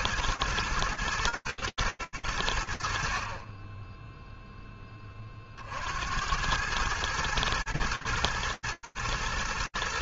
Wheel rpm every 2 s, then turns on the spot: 110, 0, 70, 120, 120.
none